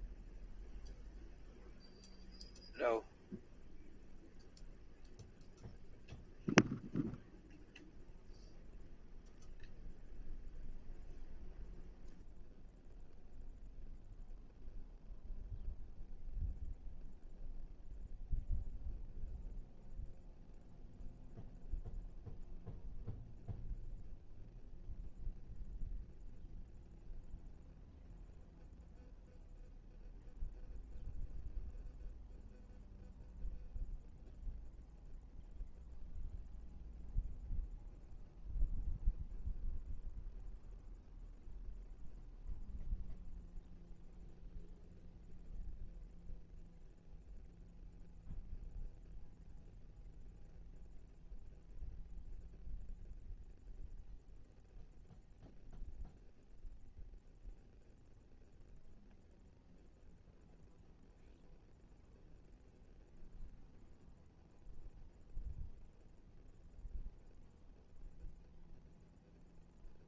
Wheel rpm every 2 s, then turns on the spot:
0, 0, 0, 0, 0, 0, 0, 0, 0, 0, 0, 0, 0, 0, 0, 0, 0, 0, 0, 0, 0, 0, 0, 0, 0, 0, 0, 0, 0, 0, 0, 0, 0, 0, 0.
none